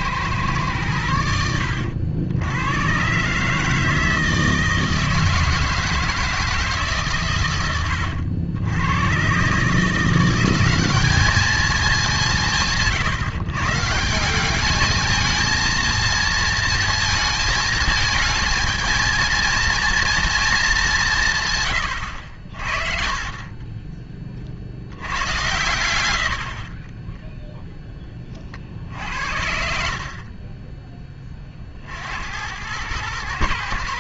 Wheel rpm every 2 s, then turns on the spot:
110, 90, 160, 160, 90, 190, 160, 200, 230, 220, 220, 50, 60, 30, 40, 20, 100.
26-28